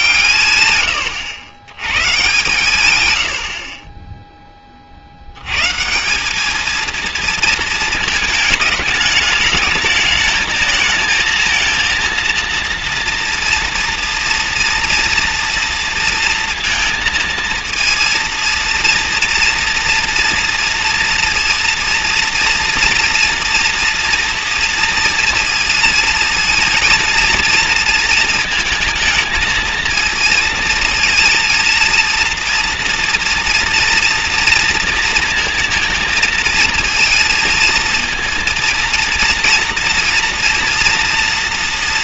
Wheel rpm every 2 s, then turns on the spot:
130, 130, 50, 220, 210, 220, 230, 230, 230, 230, 230, 230, 230, 230, 230, 230, 230, 230, 230, 230, 230.
none